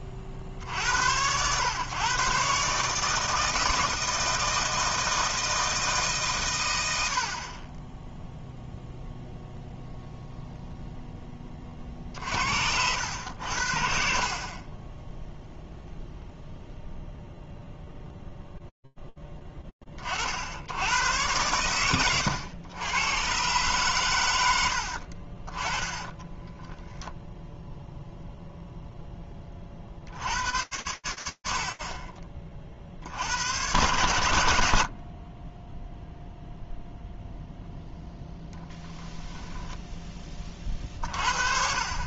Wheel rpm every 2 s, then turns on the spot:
60, 140, 160, 120, 0, 0, 70, 30, 0, 20, 110, 120, 40, 10, 30, 50, 80, 0, 0, 10, 50.
24-26